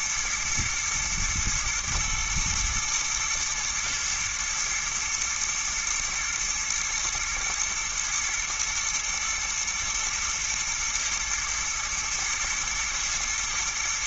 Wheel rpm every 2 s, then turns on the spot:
110, 120, 110, 110, 110, 110, 110.
none